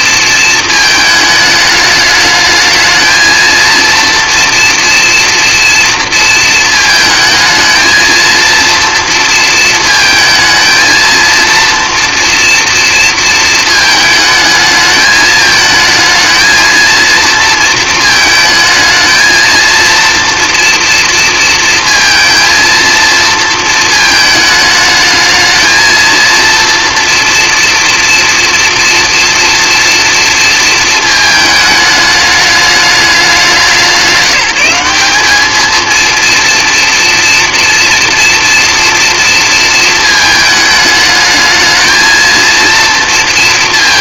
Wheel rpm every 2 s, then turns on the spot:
220, 220, 230, 220, 230, 220, 230, 220, 230, 220, 230, 230, 220, 230, 230, 230, 200, 190, 230, 230, 220, 230.
none